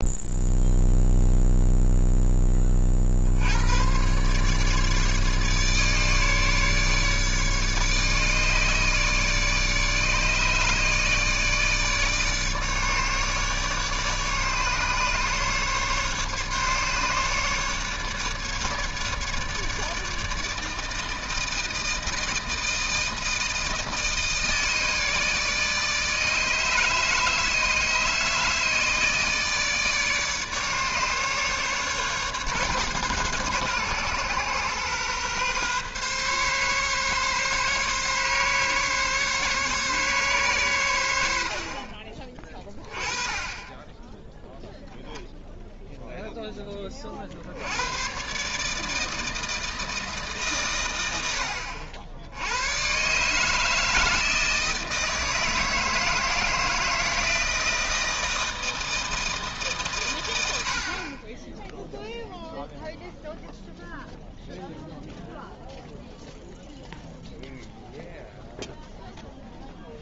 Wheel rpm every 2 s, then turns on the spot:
0, 30, 150, 150, 150, 150, 150, 150, 150, 150, 160, 160, 160, 150, 150, 150, 140, 130, 140, 140, 110, 20, 10, 20, 150, 130, 110, 160, 160, 160, 70, 0, 0, 0, 0.
none